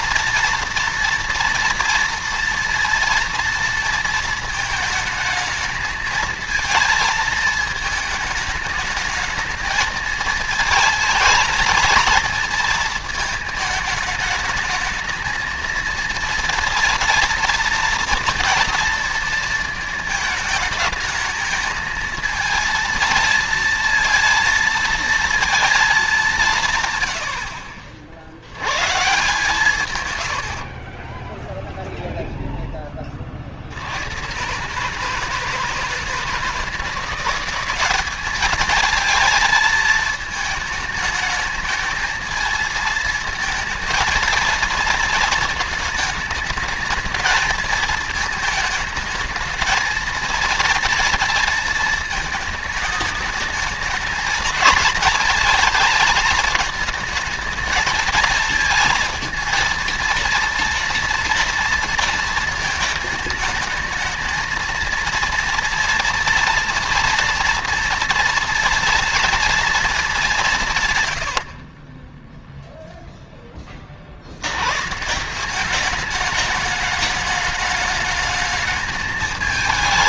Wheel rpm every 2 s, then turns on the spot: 230, 230, 220, 230, 210, 220, 220, 220, 230, 230, 220, 230, 230, 110, 130, 40, 10, 150, 180, 220, 220, 220, 230, 220, 220, 230, 220, 220, 220, 230, 230, 220, 230, 230, 230, 120, 0, 140, 210, 210.
30-32